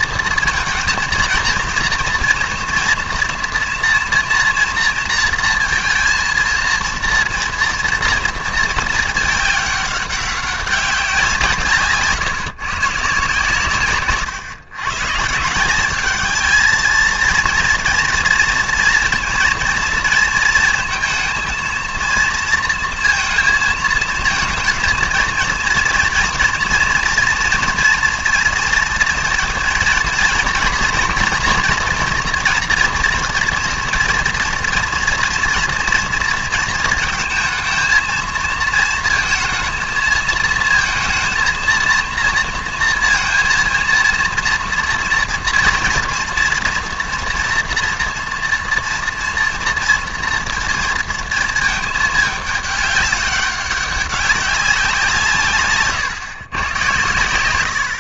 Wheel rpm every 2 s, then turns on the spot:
230, 230, 230, 230, 230, 200, 150, 130, 220, 230, 230, 230, 230, 230, 240, 240, 230, 230, 230, 230, 230, 230, 230, 230, 230, 230, 210, 190, 120.
none